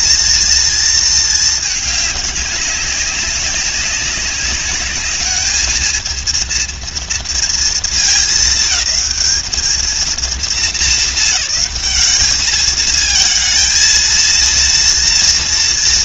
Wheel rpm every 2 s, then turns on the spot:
220, 190, 210, 230, 200, 200, 220, 230.
none